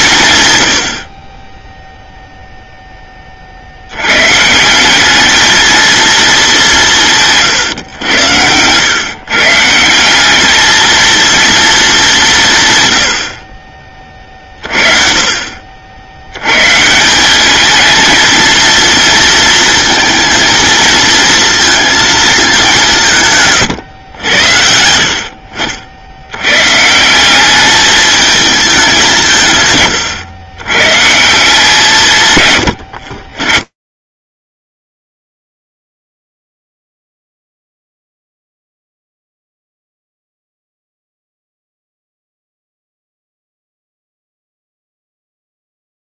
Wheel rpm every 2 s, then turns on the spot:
130, 10, 200, 170, 120, 220, 90, 40, 190, 220, 230, 150, 70, 200, 150, 170, 30, 10, 0, 0, 0, 0, 0.
none